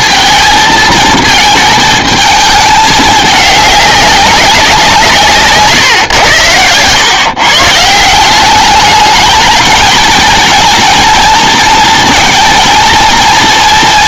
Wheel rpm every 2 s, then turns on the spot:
220, 220, 180, 110, 200, 220, 230.
6-8